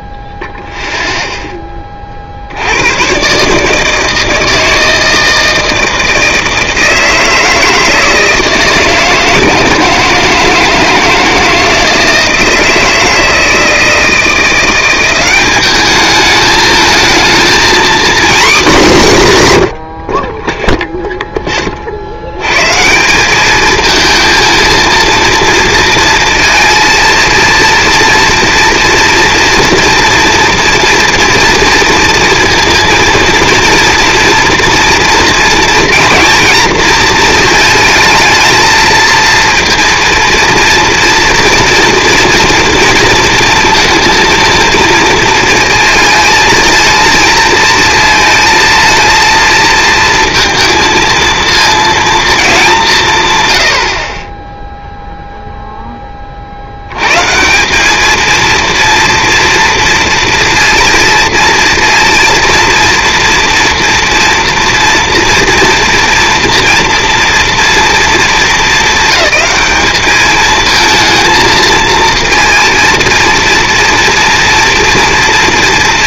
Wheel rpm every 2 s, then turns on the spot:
0, 100, 160, 160, 160, 170, 160, 190, 220, 210, 0, 150, 220, 230, 230, 240, 230, 230, 230, 220, 230, 230, 230, 230, 220, 230, 180, 0, 90, 230, 230, 230, 230, 240, 220, 220, 230, 230.
none